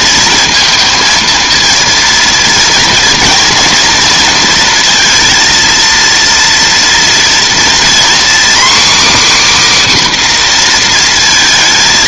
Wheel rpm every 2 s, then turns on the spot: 230, 230, 230, 230, 270, 250.
none